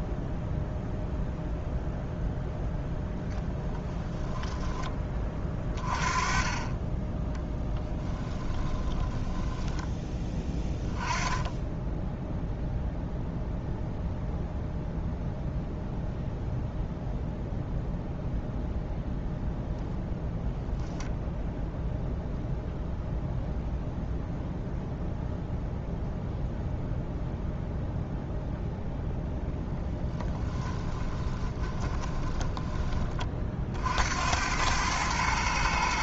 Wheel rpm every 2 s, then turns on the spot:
0, 0, 20, 20, 20, 10, 0, 0, 0, 0, 0, 0, 0, 0, 0, 20, 20, 100.
8-10 30-32